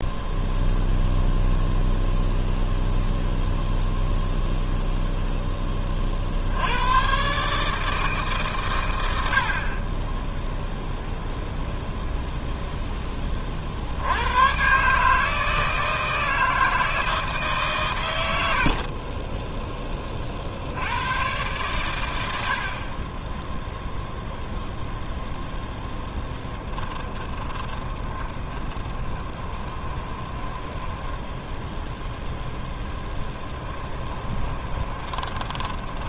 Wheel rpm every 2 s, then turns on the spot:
0, 0, 0, 110, 110, 0, 10, 140, 160, 50, 80, 40, 0, 10, 20, 10, 10, 20.
18-20 26-36